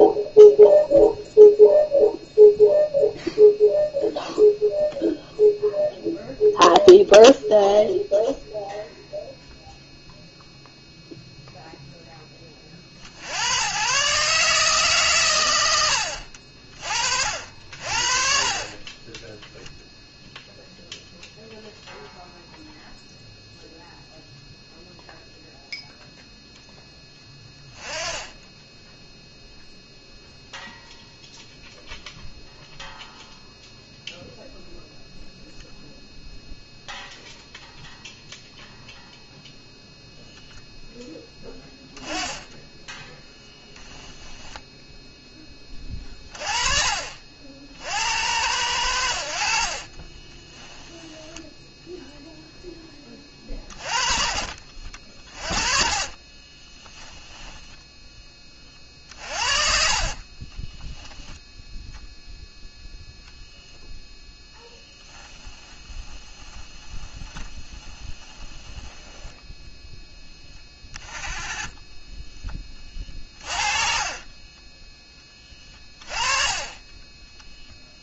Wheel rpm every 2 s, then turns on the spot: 0, 0, 0, 0, 0, 0, 30, 150, 50, 30, 0, 0, 0, 0, 10, 0, 0, 0, 0, 0, 0, 10, 10, 40, 80, 10, 10, 40, 20, 30, 10, 0, 0, 10, 10, 10, 20, 20, 30.
42-44 50-52 56-62 74-76